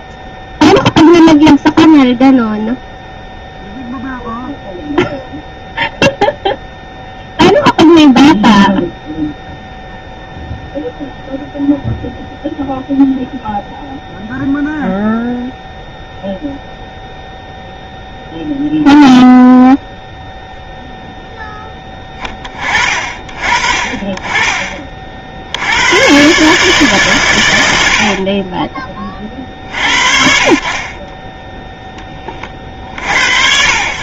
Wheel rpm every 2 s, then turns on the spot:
0, 0, 0, 0, 0, 0, 0, 0, 0, 0, 0, 30, 30, 140, 30, 40, 50.
none